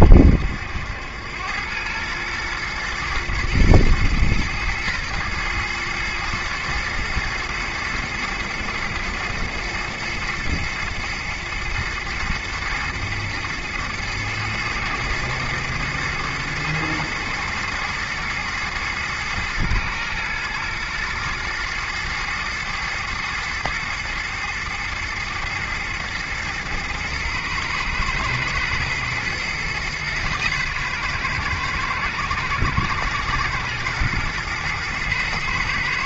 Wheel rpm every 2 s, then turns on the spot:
80, 120, 110, 120, 120, 120, 120, 110, 110, 110, 110, 110, 110, 120, 110, 120, 110, 120.
none